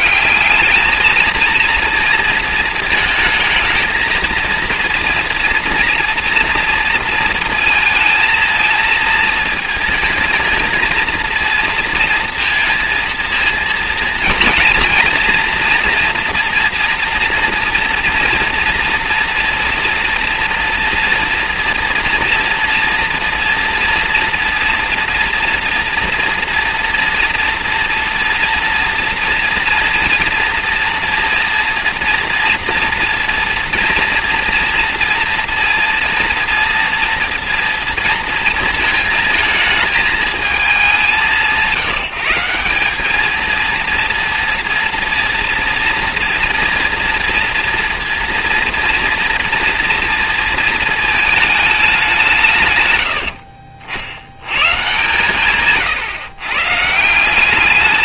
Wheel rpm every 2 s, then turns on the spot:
220, 220, 230, 230, 230, 230, 230, 230, 230, 230, 240, 230, 240, 240, 230, 230, 230, 230, 230, 220, 190, 210, 230, 230, 230, 220, 90, 140, 170.
none